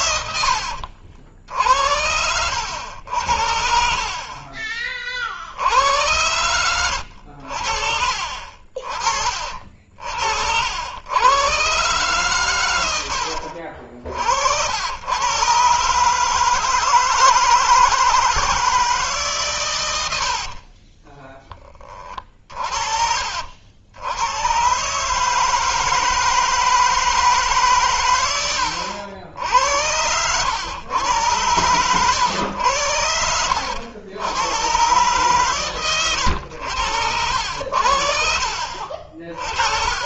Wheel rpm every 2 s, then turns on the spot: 90, 80, 40, 90, 50, 60, 110, 70, 150, 170, 60, 40, 110, 160, 100, 100, 100, 100, 90, 60.
0-2 20-22